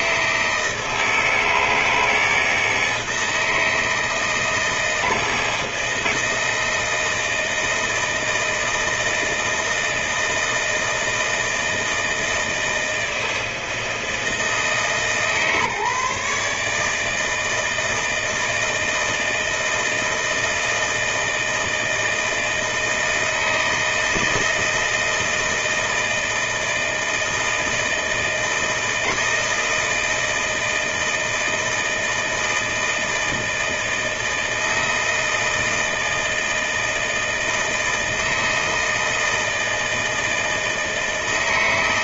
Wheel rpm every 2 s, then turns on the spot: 160, 160, 160, 160, 160, 160, 160, 150, 150, 160, 160, 160, 160, 160, 160, 160, 160, 160, 160, 160, 160.
none